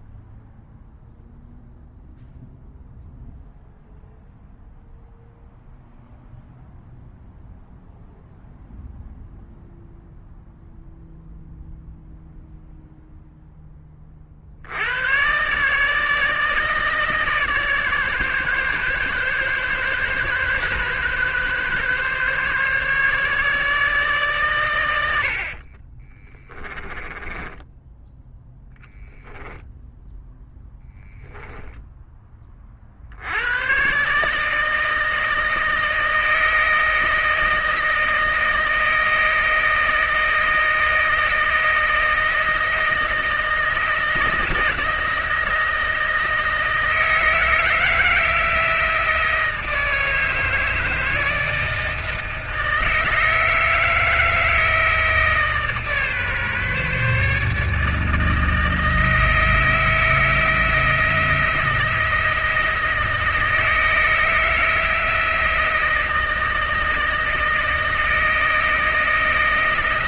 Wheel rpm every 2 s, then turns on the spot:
0, 0, 0, 0, 0, 0, 0, 90, 150, 140, 130, 140, 110, 20, 0, 0, 40, 160, 160, 160, 160, 160, 160, 160, 170, 160, 160, 160, 150, 160, 170, 160, 160, 160, 160.
26-28